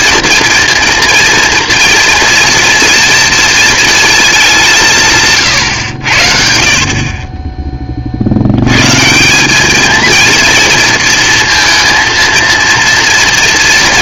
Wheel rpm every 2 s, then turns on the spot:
230, 230, 200, 50, 110, 230, 230.
none